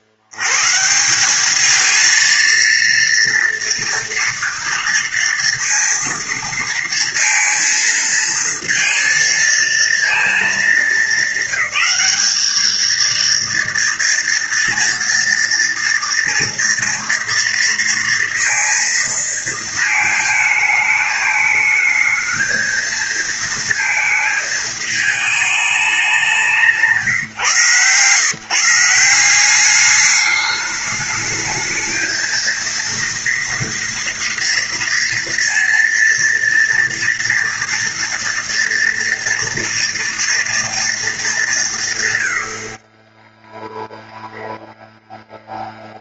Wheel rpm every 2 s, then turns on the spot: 90, 230, 230, 230, 230, 220, 210, 230, 230, 230, 220, 220, 220, 180, 160, 210, 220, 230, 230, 230, 230, 110, 0.
none